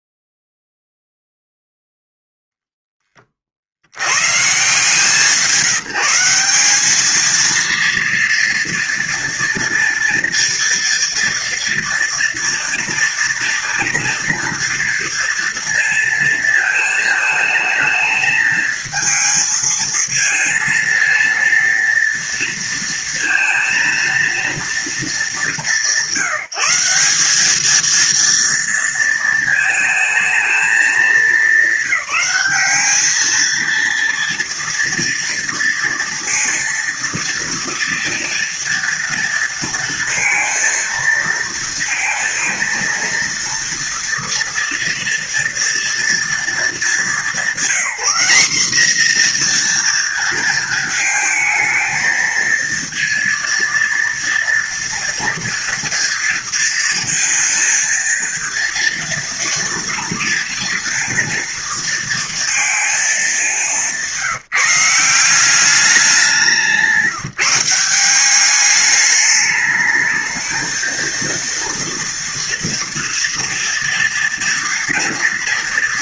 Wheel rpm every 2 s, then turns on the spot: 0, 0, 120, 180, 230, 230, 230, 240, 230, 220, 230, 230, 230, 170, 230, 220, 200, 230, 230, 230, 230, 230, 230, 230, 210, 230, 220, 230, 230, 230, 230, 230, 170, 200, 200, 220, 240, 230.
none